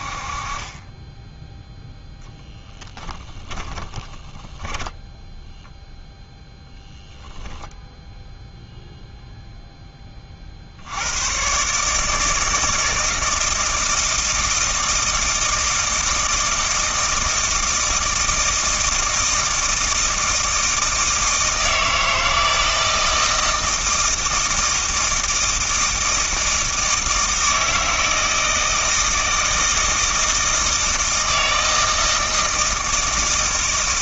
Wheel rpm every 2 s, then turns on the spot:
20, 10, 10, 0, 0, 70, 160, 160, 160, 160, 160, 160, 160, 160, 160, 160, 160.
2-6